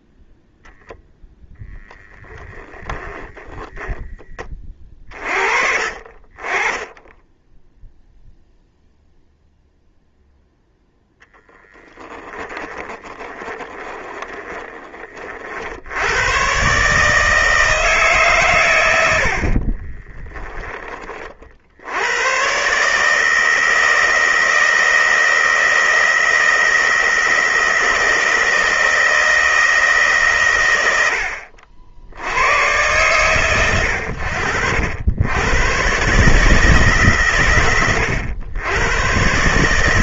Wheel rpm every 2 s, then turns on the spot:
0, 10, 20, 20, 0, 0, 10, 20, 130, 110, 20, 130, 160, 160, 160, 120, 100, 70, 150, 100.
2-4 12-14